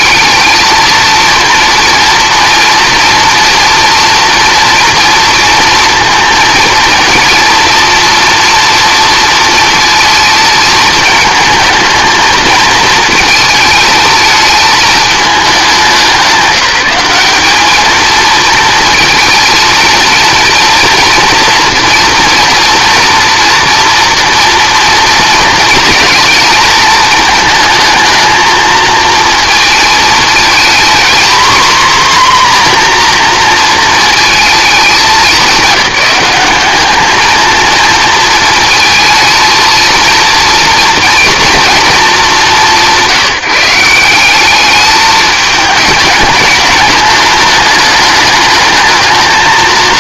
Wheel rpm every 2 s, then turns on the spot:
220, 230, 230, 230, 230, 220, 220, 220, 190, 220, 230, 230, 230, 230, 220, 240, 250, 210, 210, 220, 230, 160, 210, 210, 220.
none